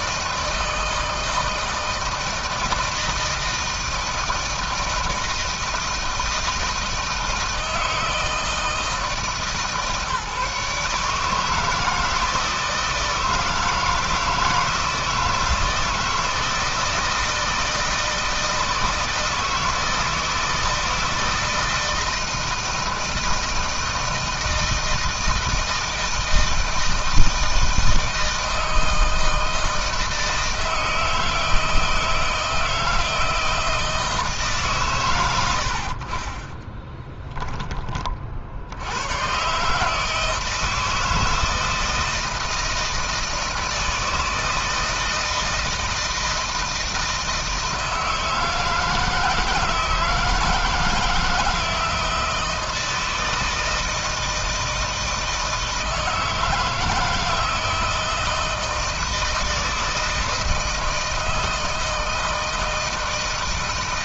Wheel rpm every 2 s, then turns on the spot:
160, 160, 160, 160, 160, 150, 160, 160, 160, 160, 160, 160, 160, 160, 160, 160, 160, 120, 10, 90, 160, 160, 160, 160, 160, 160, 160, 160, 160, 160, 160, 160.
36-38